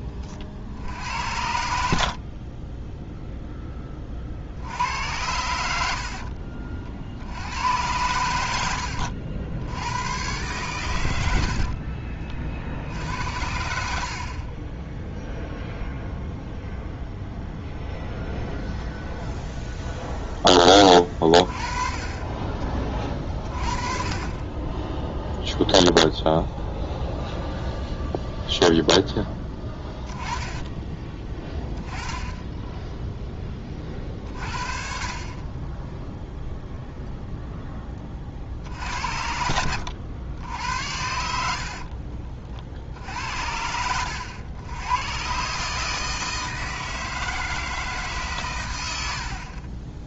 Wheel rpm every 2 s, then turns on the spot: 50, 30, 70, 40, 80, 120, 50, 40, 0, 0, 10, 20, 20, 0, 0, 20, 10, 40, 0, 50, 80, 50, 100, 160, 120.
8-10